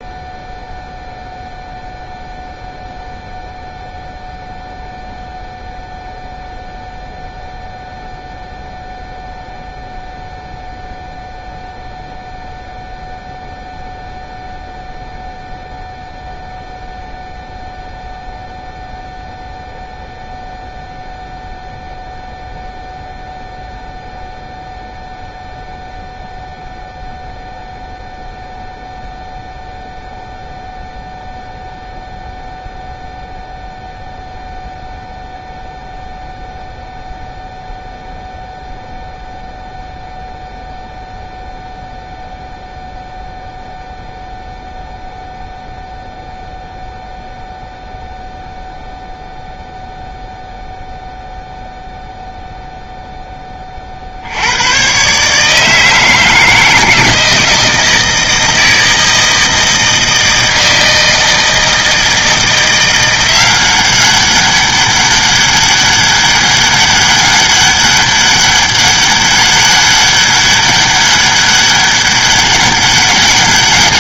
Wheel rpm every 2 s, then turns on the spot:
0, 0, 0, 0, 0, 0, 0, 0, 0, 0, 0, 0, 0, 0, 0, 0, 0, 0, 0, 0, 0, 0, 0, 0, 0, 0, 0, 110, 160, 160, 160, 170, 200, 200, 200, 200, 200.
none